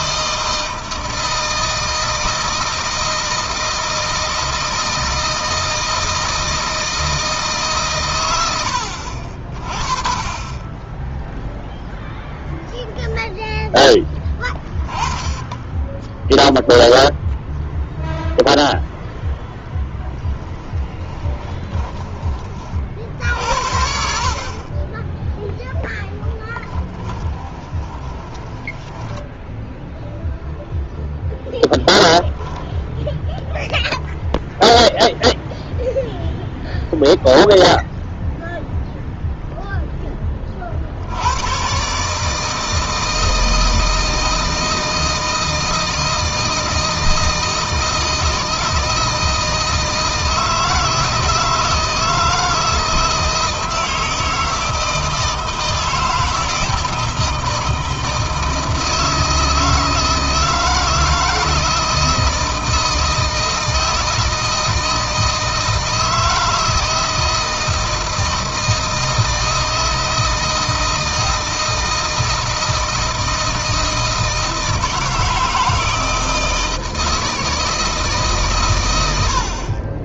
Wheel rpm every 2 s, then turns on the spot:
160, 160, 160, 160, 80, 20, 0, 20, 0, 0, 10, 40, 20, 20, 10, 0, 0, 0, 0, 0, 50, 160, 160, 160, 160, 160, 160, 160, 160, 160, 170, 160, 160, 160, 160, 160, 160, 160, 160, 120.
20-22 26-30